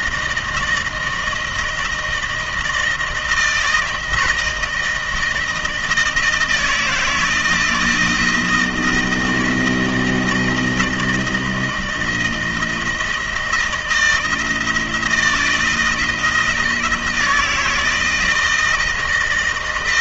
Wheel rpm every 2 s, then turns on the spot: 160, 160, 160, 160, 160, 160, 160, 160, 170, 160.
none